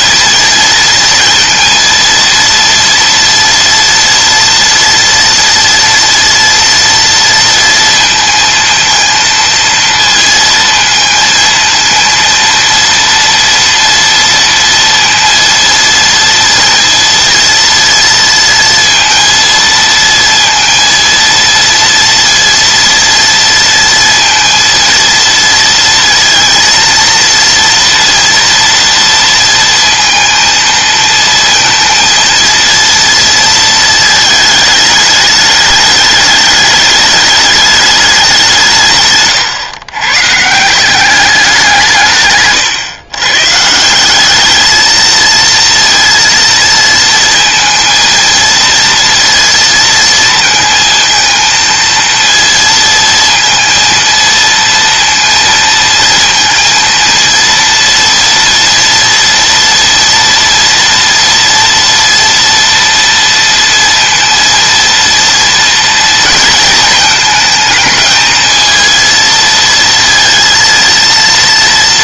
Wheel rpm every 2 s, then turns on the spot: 230, 230, 230, 230, 230, 230, 230, 230, 230, 230, 230, 230, 230, 230, 230, 230, 230, 210, 210, 160, 170, 140, 220, 230, 230, 220, 230, 230, 230, 230, 240, 230, 230, 220, 230, 230.
none